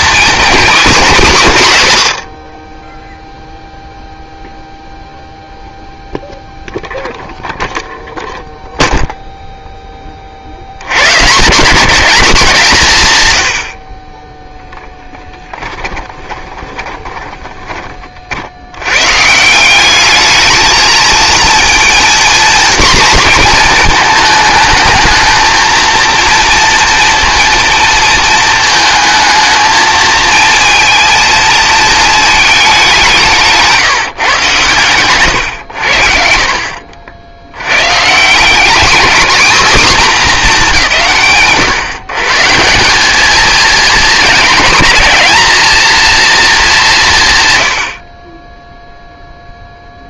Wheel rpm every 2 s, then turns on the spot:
230, 20, 0, 0, 0, 150, 110, 10, 20, 130, 220, 240, 220, 230, 220, 230, 190, 130, 60, 230, 170, 190, 210, 160, 0.
14-18 34-36